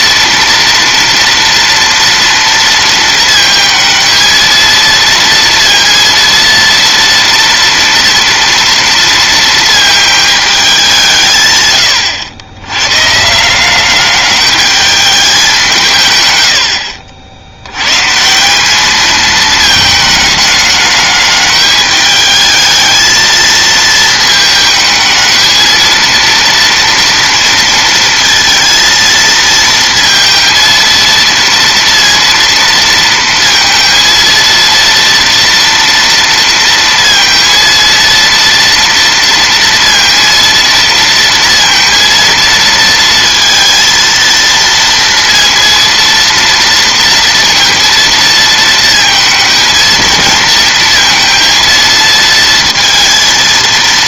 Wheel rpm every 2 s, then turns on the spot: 230, 230, 230, 230, 230, 200, 110, 210, 80, 200, 210, 220, 220, 230, 230, 230, 230, 230, 230, 230, 230, 230, 230, 230, 220, 230, 230.
none